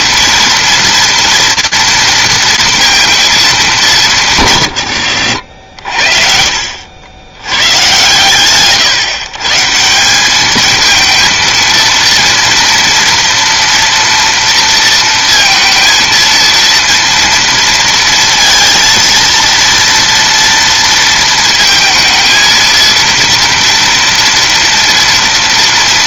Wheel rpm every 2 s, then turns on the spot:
230, 230, 130, 60, 140, 220, 230, 230, 230, 230, 230, 230, 230.
none